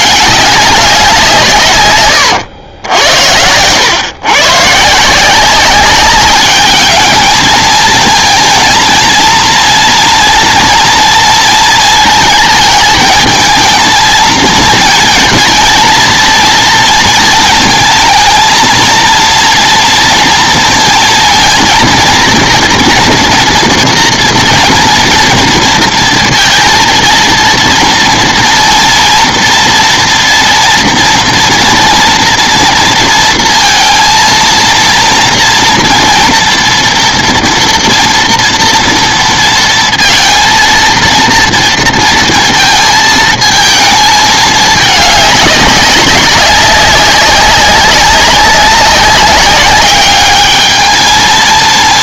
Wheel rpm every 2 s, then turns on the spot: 200, 90, 140, 200, 230, 230, 220, 230, 230, 230, 230, 230, 230, 230, 230, 230, 230, 230, 230, 230, 230, 230, 210, 200, 200, 210.
2-4